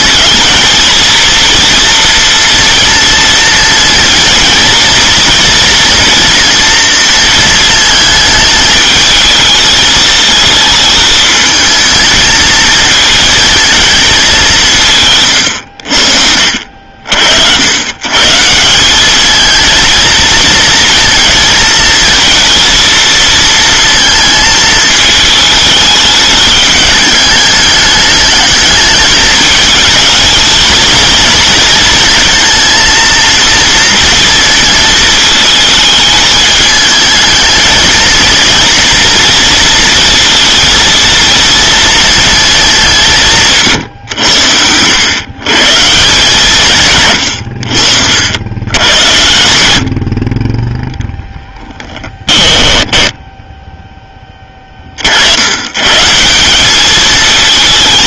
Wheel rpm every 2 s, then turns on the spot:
220, 230, 230, 230, 220, 220, 220, 170, 60, 170, 230, 230, 220, 210, 210, 220, 230, 230, 220, 230, 230, 220, 90, 140, 100, 20, 10, 30, 190.
52-54